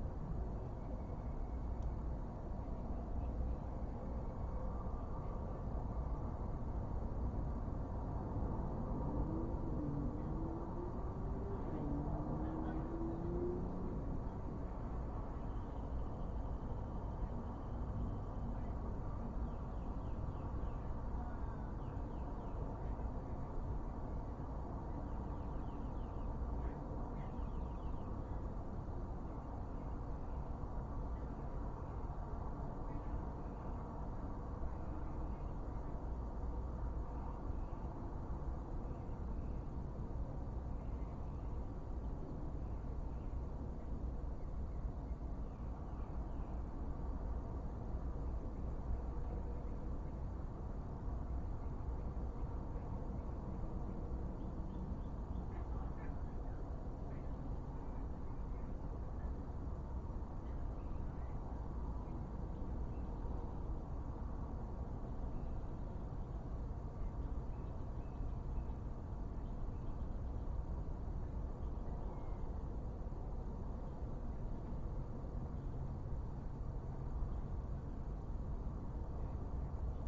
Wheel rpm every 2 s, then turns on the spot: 0, 0, 0, 0, 0, 0, 0, 0, 0, 0, 0, 0, 0, 0, 0, 0, 0, 0, 0, 0, 0, 0, 0, 0, 0, 0, 0, 0, 0, 0, 0, 0, 0, 0, 0, 0, 0, 0, 0, 0.
none